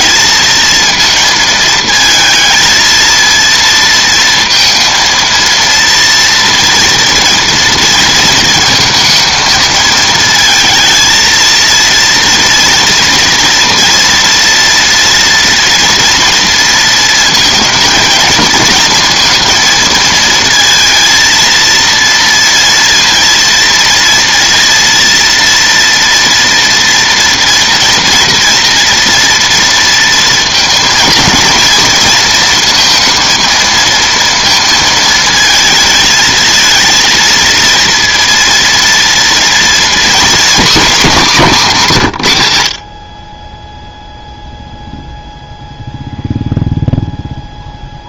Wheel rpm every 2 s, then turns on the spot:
230, 230, 230, 230, 230, 230, 230, 230, 230, 230, 230, 230, 230, 230, 240, 230, 230, 230, 230, 230, 230, 80, 0, 0.
none